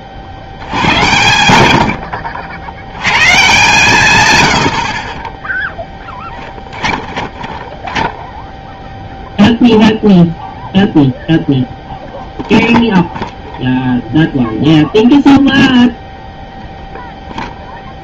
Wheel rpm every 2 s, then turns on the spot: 80, 80, 100, 20, 0, 0, 0, 0, 0.
4-8